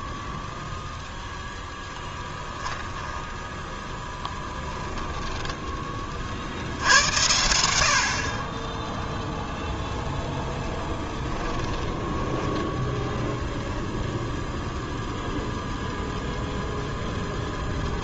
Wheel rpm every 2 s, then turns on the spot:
10, 10, 10, 70, 20, 10, 10, 0, 20.
4-6 10-14 16-18